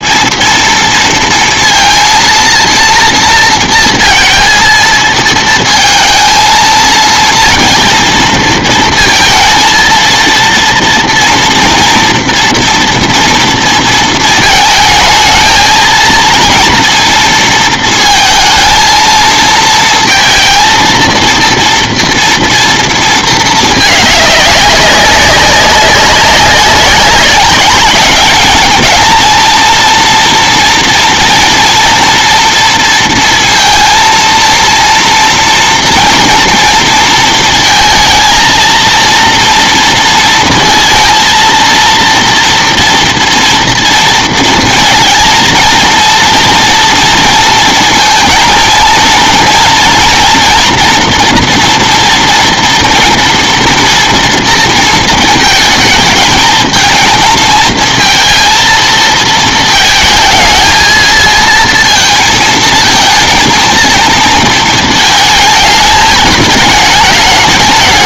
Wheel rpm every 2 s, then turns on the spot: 230, 230, 230, 230, 230, 230, 230, 220, 230, 220, 230, 230, 200, 200, 220, 230, 230, 230, 230, 230, 230, 230, 230, 230, 220, 230, 230, 230, 220, 230, 220, 230, 220, 210.
none